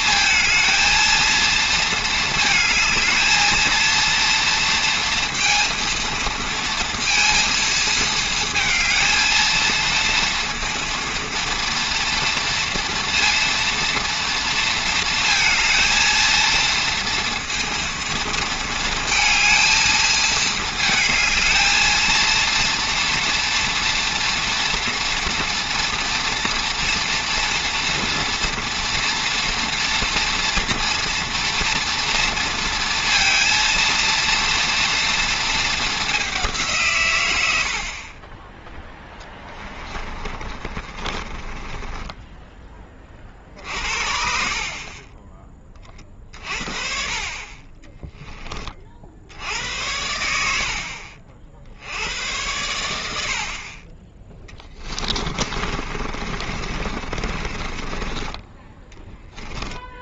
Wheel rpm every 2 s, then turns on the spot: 220, 220, 230, 230, 220, 230, 230, 230, 230, 230, 220, 230, 230, 230, 230, 230, 230, 230, 190, 30, 30, 10, 60, 50, 10, 80, 90, 10, 50, 20.
40-42 54-60